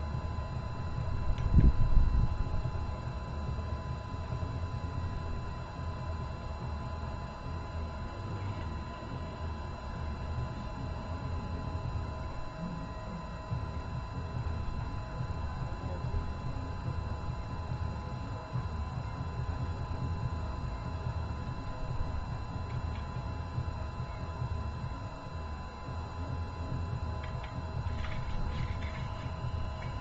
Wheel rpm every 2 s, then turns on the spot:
0, 0, 0, 0, 0, 0, 0, 0, 0, 0, 0, 0, 0, 0, 0.
none